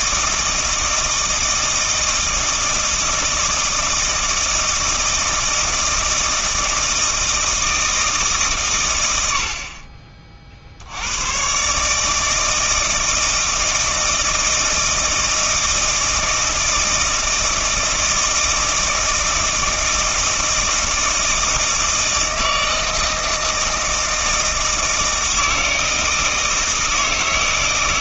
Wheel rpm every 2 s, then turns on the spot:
160, 160, 160, 160, 130, 70, 160, 160, 160, 160, 160, 160, 160, 160.
none